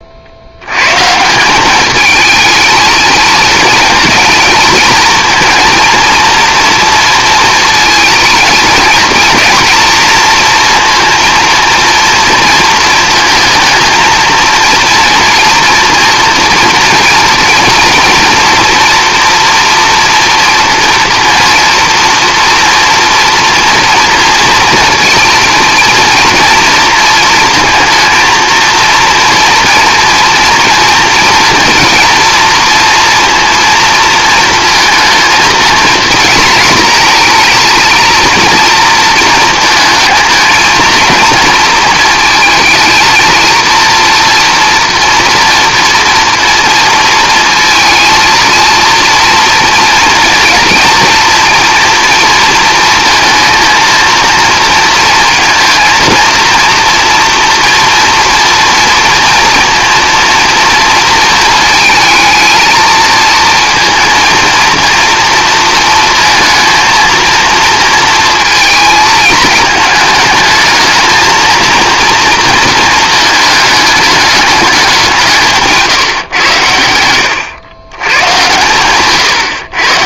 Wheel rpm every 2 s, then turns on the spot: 100, 220, 220, 230, 220, 230, 230, 230, 230, 240, 240, 240, 230, 230, 230, 230, 230, 220, 230, 230, 230, 230, 230, 230, 230, 230, 230, 230, 230, 230, 230, 230, 230, 230, 220, 220, 220, 210, 120, 120.
none